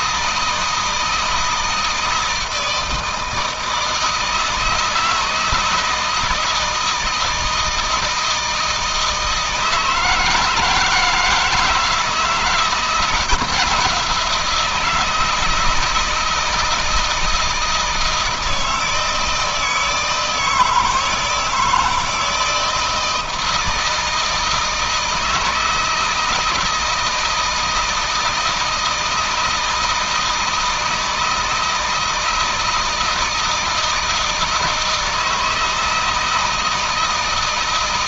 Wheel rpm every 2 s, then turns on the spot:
160, 160, 160, 170, 160, 160, 160, 170, 160, 160, 160, 160, 160, 160, 160, 160, 160, 160, 160.
none